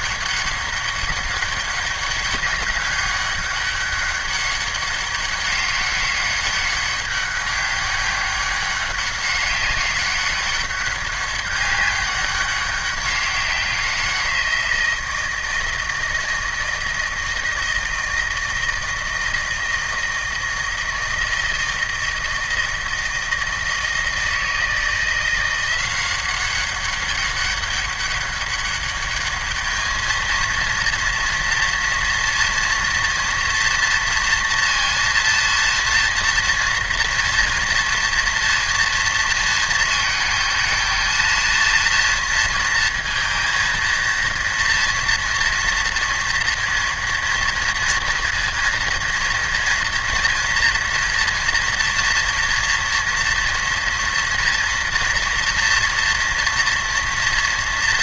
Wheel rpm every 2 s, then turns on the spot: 200, 200, 200, 200, 200, 200, 200, 170, 160, 160, 160, 160, 160, 190, 200, 230, 230, 230, 230, 230, 220, 230, 230, 230, 230, 230, 240, 240, 230.
none